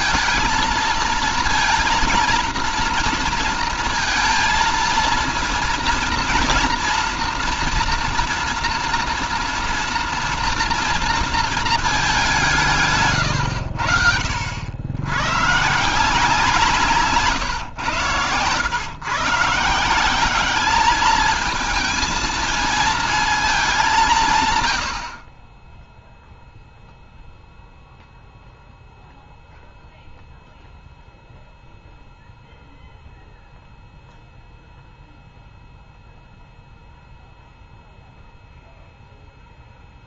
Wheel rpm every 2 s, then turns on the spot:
230, 230, 230, 230, 230, 230, 170, 80, 170, 140, 200, 220, 120, 0, 0, 0, 0, 0, 0, 0.
none